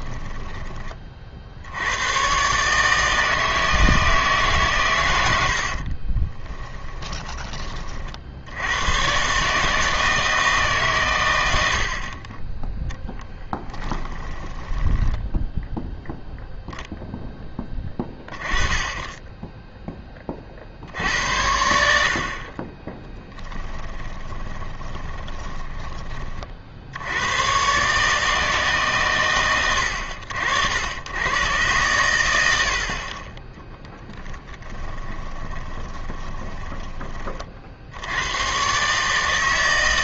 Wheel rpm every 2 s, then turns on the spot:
20, 140, 140, 20, 90, 150, 10, 20, 0, 20, 50, 30, 20, 50, 140, 80, 70, 10, 20, 130.
6-8 14-16 24-26 34-38